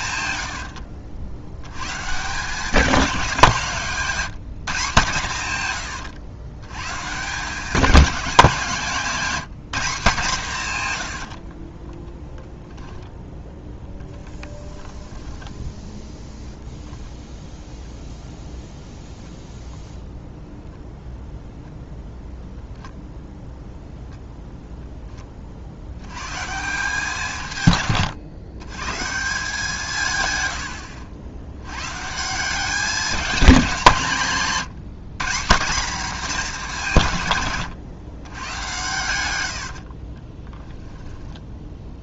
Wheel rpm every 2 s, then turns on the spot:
70, 200, 160, 120, 190, 150, 10, 10, 0, 0, 0, 0, 0, 160, 130, 100, 190, 180, 190, 110, 20.
0-2 14-16 40-42